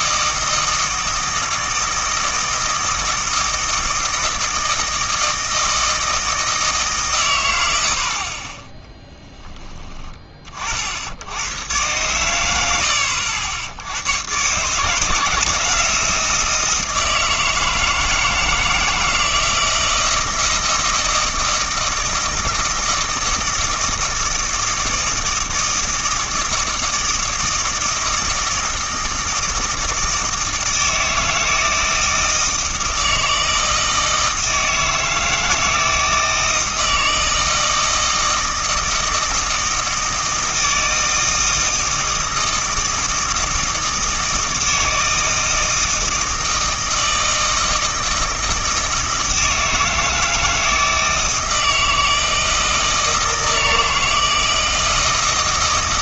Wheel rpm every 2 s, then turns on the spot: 160, 160, 160, 150, 20, 50, 100, 150, 160, 160, 160, 160, 160, 160, 160, 160, 160, 160, 160, 160, 160, 160, 160, 160, 160, 160, 160, 160.
none